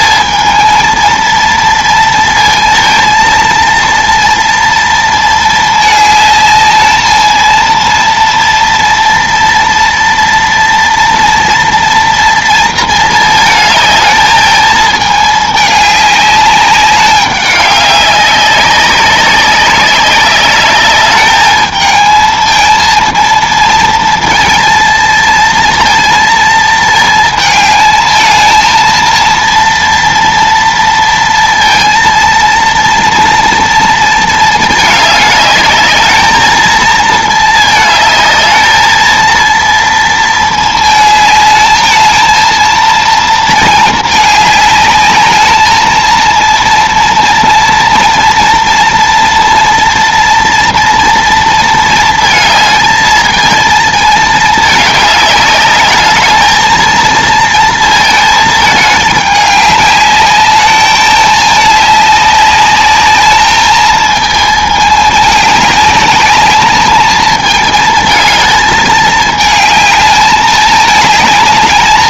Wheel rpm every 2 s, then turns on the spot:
220, 230, 230, 210, 230, 230, 230, 220, 200, 190, 200, 220, 230, 220, 220, 230, 230, 220, 220, 220, 220, 230, 210, 230, 230, 230, 220, 220, 220, 220, 210, 200, 220, 210, 220, 210.
none